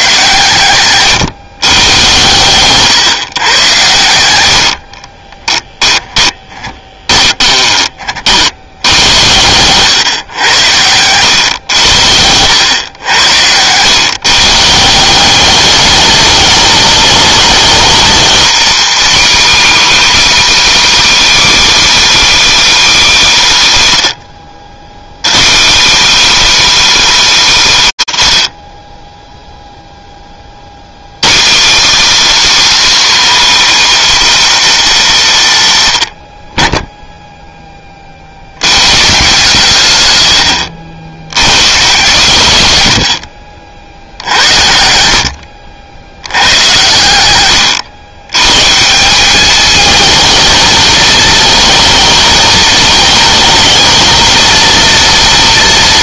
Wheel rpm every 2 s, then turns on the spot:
130, 150, 40, 20, 90, 100, 100, 170, 210, 250, 290, 280, 110, 290, 50, 150, 300, 200, 10, 140, 90, 60, 70, 100, 200, 220, 220, 230.
0-2 4-8 42-48